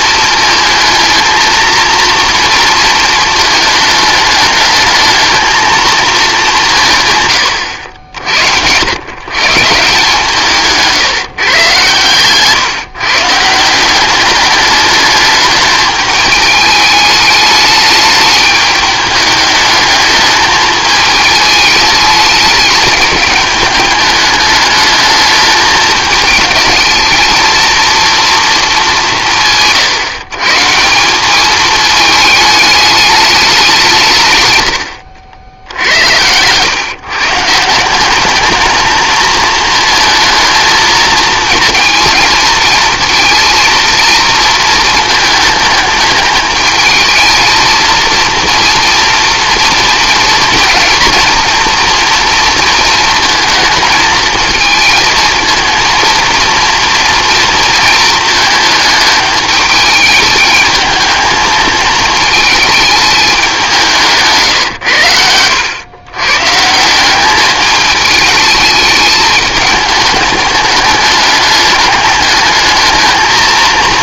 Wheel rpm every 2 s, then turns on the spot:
220, 230, 210, 170, 80, 160, 140, 210, 210, 210, 220, 220, 210, 220, 220, 160, 210, 110, 120, 220, 230, 230, 230, 210, 230, 240, 230, 220, 230, 220, 210, 220, 160, 150, 220, 210, 220.
10-12